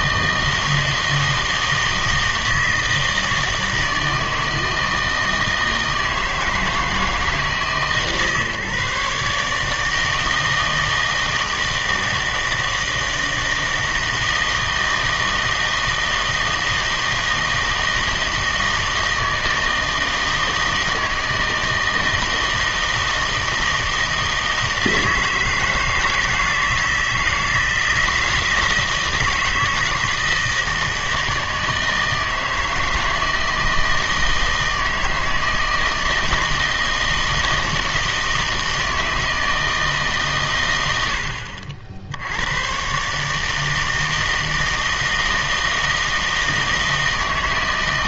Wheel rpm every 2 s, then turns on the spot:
160, 160, 160, 160, 140, 160, 160, 160, 160, 160, 160, 160, 160, 160, 160, 160, 160, 160, 160, 160, 120, 110, 160, 160.
none